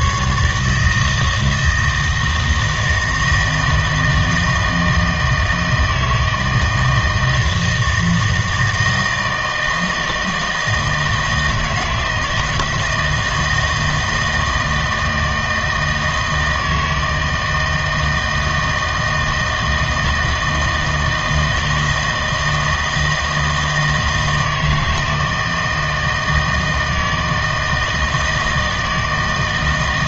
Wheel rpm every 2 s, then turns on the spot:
150, 160, 160, 160, 160, 160, 160, 160, 160, 160, 160, 160, 160, 160, 160.
none